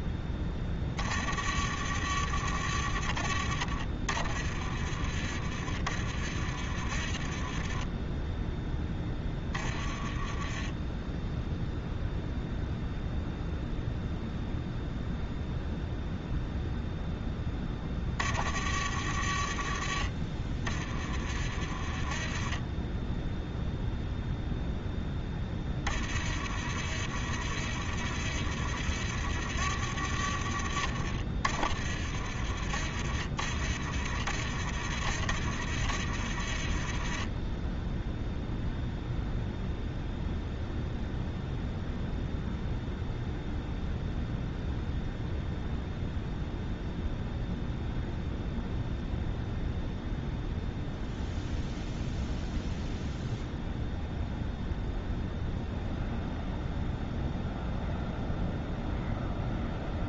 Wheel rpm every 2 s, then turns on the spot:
10, 50, 30, 30, 10, 20, 0, 0, 0, 30, 20, 20, 0, 40, 40, 40, 30, 40, 30, 0, 0, 0, 0, 0, 0, 0, 0, 0, 0, 0.
8-12